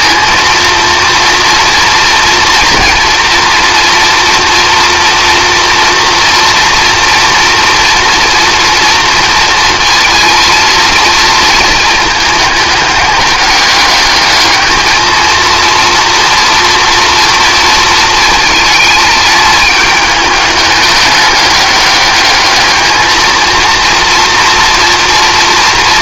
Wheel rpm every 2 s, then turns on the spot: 230, 230, 230, 230, 230, 230, 210, 220, 230, 220, 210, 220, 230.
none